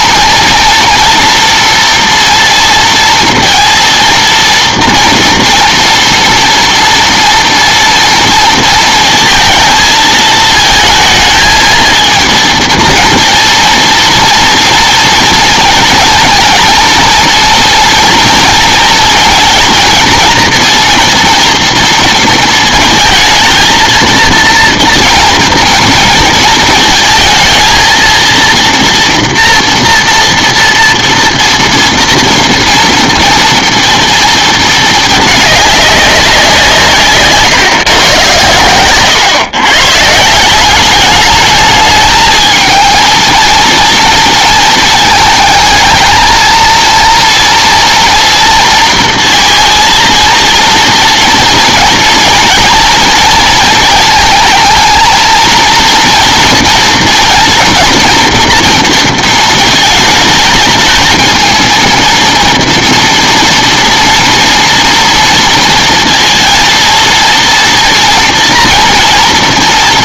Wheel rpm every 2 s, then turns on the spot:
230, 230, 230, 230, 230, 230, 230, 230, 230, 230, 230, 230, 230, 220, 230, 230, 230, 220, 170, 110, 180, 220, 230, 230, 230, 230, 230, 220, 230, 230, 220, 230, 240, 230, 240.
none